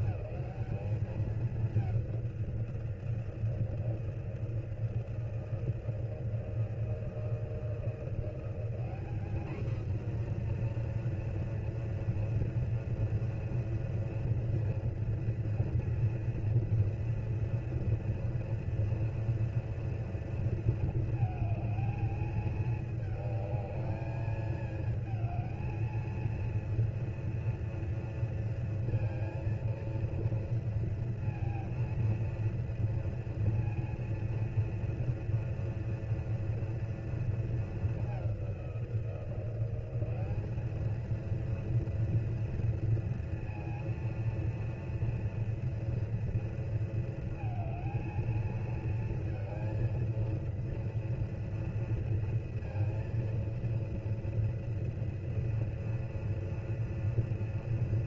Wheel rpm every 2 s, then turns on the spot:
210, 180, 170, 160, 190, 240, 230, 230, 230, 230, 230, 220, 220, 230, 230, 230, 230, 230, 230, 190, 210, 230, 230, 230, 230, 230, 230, 230, 230.
none